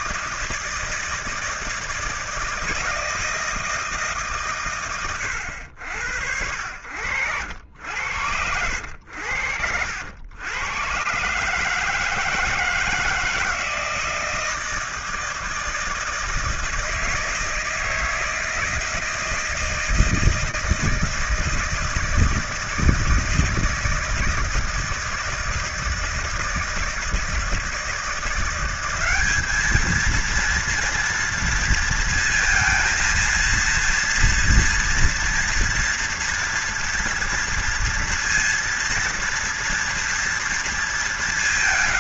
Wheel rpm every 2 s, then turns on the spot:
160, 160, 130, 70, 90, 100, 160, 160, 160, 160, 160, 160, 160, 160, 180, 230, 230, 230, 230, 230, 230.
none